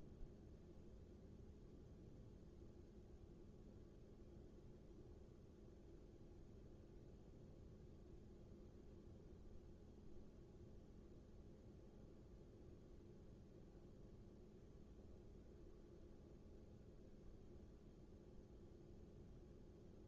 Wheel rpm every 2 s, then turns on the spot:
0, 0, 0, 0, 0, 0, 0, 0, 0, 0.
none